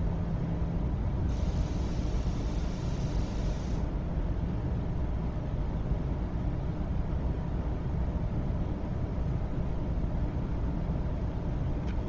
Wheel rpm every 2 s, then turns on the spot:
0, 0, 0, 0, 0, 0.
none